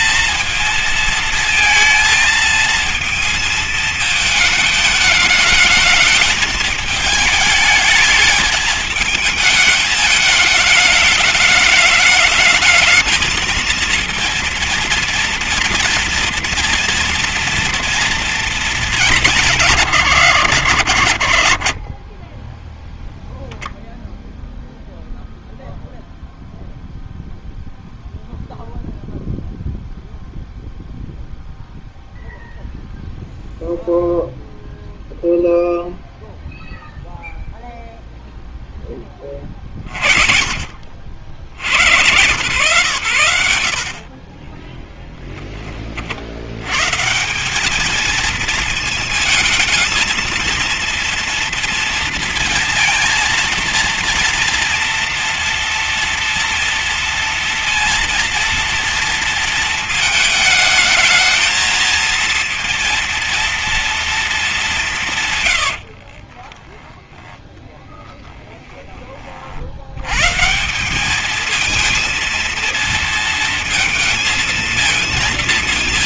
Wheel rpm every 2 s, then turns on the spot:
230, 220, 220, 220, 210, 210, 220, 230, 240, 220, 100, 20, 0, 0, 0, 0, 0, 0, 0, 0, 40, 110, 30, 100, 230, 230, 230, 230, 230, 230, 220, 230, 220, 30, 30, 140, 230, 230.
44-46 66-70